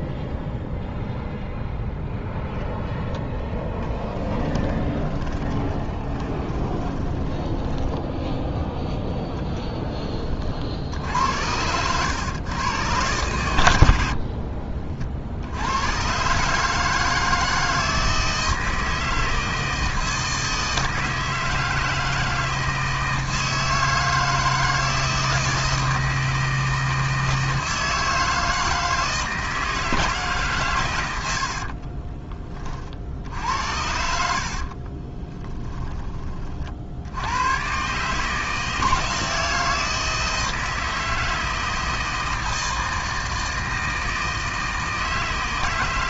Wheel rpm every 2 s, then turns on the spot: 0, 0, 20, 20, 20, 70, 120, 40, 150, 160, 160, 160, 160, 160, 160, 130, 30, 50, 60, 160, 160, 160, 160.
4-8 34-36